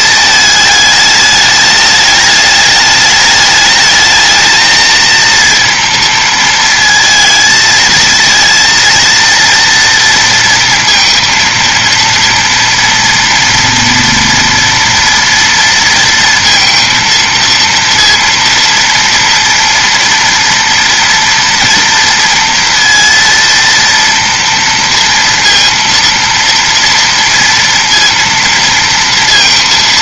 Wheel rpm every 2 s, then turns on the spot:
210, 210, 220, 230, 230, 230, 230, 240, 230, 230, 230, 230, 230, 230, 230.
none